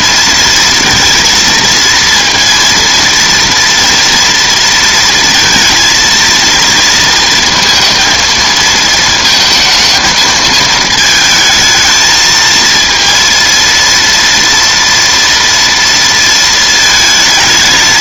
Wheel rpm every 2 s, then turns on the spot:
230, 230, 230, 230, 220, 220, 230, 230, 220.
none